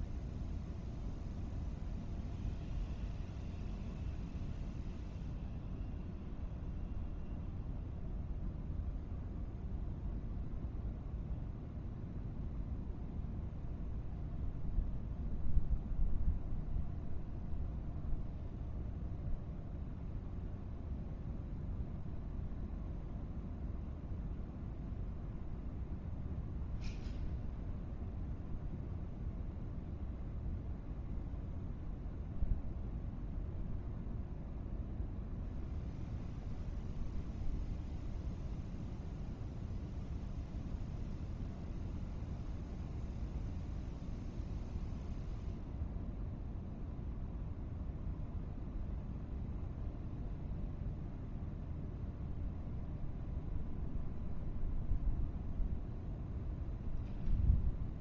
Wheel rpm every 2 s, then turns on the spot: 0, 0, 0, 0, 0, 0, 0, 0, 0, 0, 0, 0, 0, 0, 0, 0, 0, 0, 0, 0, 0, 0, 0, 0, 0, 0, 0, 0, 0.
none